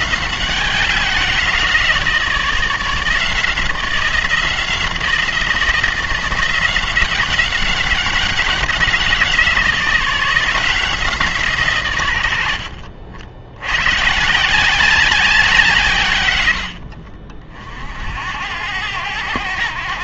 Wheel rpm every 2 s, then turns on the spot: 180, 160, 170, 180, 180, 170, 60, 180, 80, 90.
none